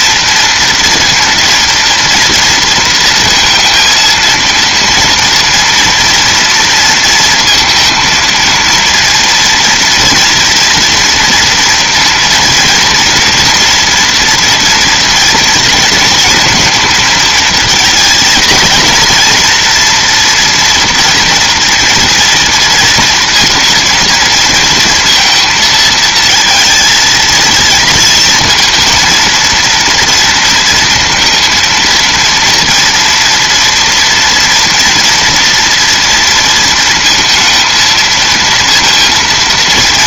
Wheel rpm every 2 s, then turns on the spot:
230, 230, 230, 230, 230, 230, 230, 230, 230, 220, 240, 230, 230, 230, 230, 230, 230, 240, 230, 230.
none